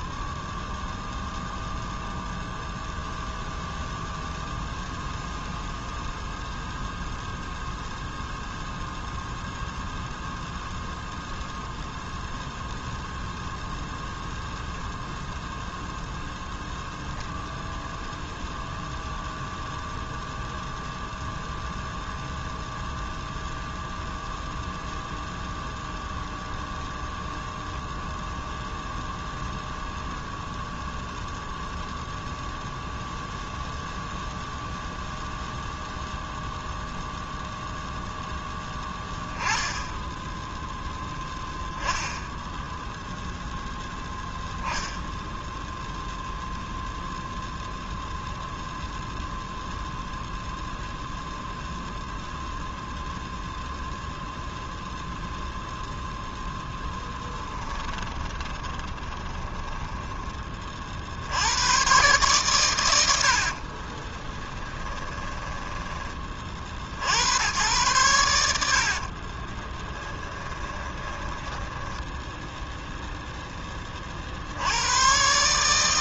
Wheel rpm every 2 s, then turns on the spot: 0, 0, 0, 0, 0, 0, 0, 0, 0, 0, 0, 0, 0, 0, 0, 0, 0, 0, 0, 10, 0, 0, 0, 0, 0, 0, 0, 0, 10, 20, 30, 110, 20, 50, 70, 20, 0, 90.
58-60 64-66 68-72